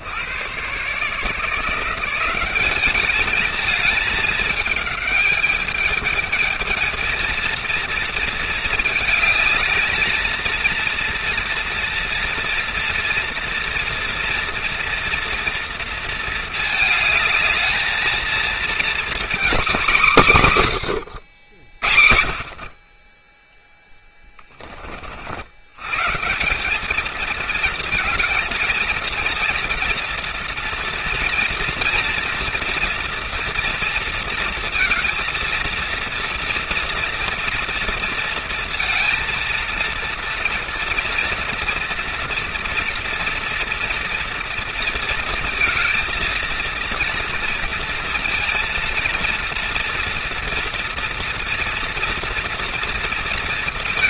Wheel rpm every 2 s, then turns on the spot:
60, 170, 220, 210, 230, 220, 240, 230, 230, 230, 210, 60, 10, 170, 230, 230, 230, 230, 230, 230, 230, 230, 230, 230, 230, 230, 230.
none